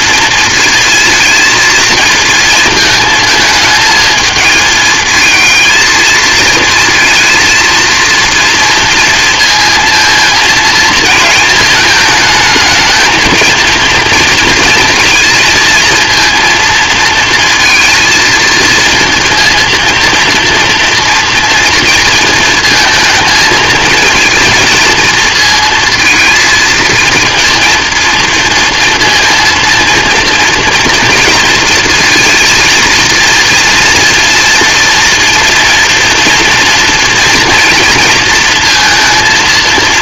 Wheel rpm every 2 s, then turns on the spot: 230, 220, 220, 230, 230, 220, 220, 230, 230, 230, 230, 220, 230, 230, 230, 230, 230, 230, 230, 230.
none